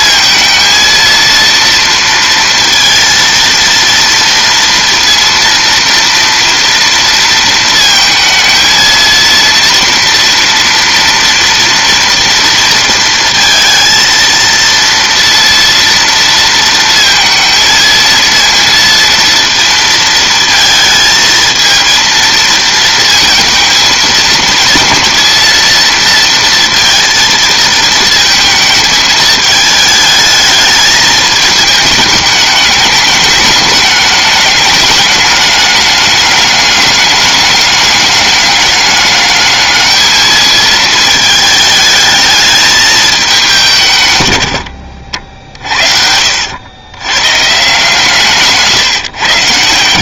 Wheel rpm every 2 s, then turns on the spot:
230, 230, 230, 230, 230, 230, 230, 230, 230, 230, 220, 220, 230, 230, 210, 210, 210, 210, 210, 200, 220, 210, 70, 100, 140.
none